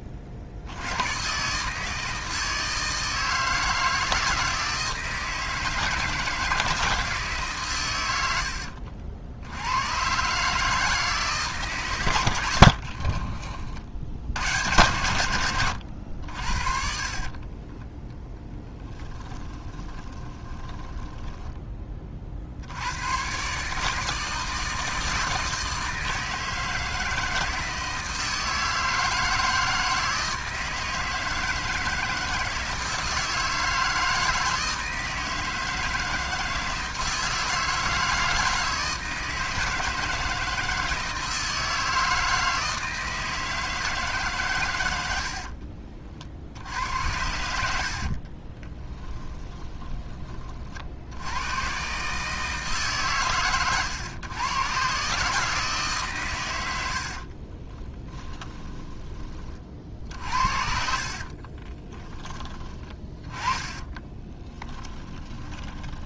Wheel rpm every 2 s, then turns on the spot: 60, 160, 160, 170, 60, 160, 60, 110, 50, 10, 20, 90, 160, 160, 160, 160, 160, 160, 160, 160, 160, 160, 90, 80, 20, 50, 150, 140, 80, 20, 50, 20, 10.
12-14 16-22 48-50 60-66